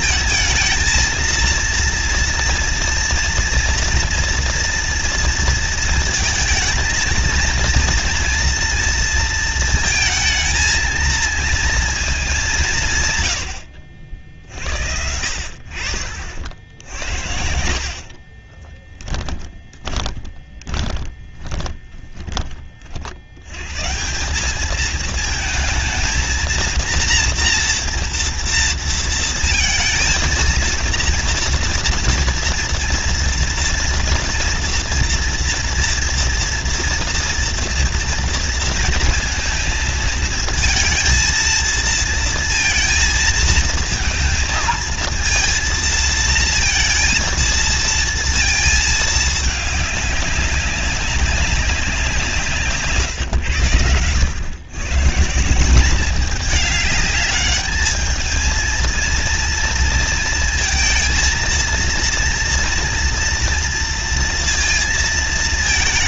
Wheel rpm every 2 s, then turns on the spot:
230, 230, 230, 230, 230, 230, 170, 60, 60, 20, 30, 40, 210, 230, 230, 230, 230, 230, 230, 230, 230, 230, 220, 230, 220, 200, 150, 120, 210, 220, 230, 240, 230.
18-22 52-54